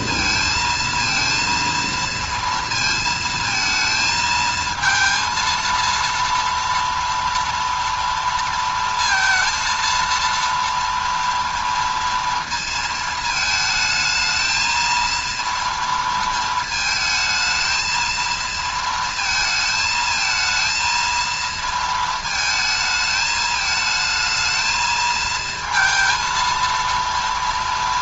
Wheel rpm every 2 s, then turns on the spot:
230, 230, 230, 230, 230, 230, 230, 220, 220, 230, 220, 220, 220, 230.
none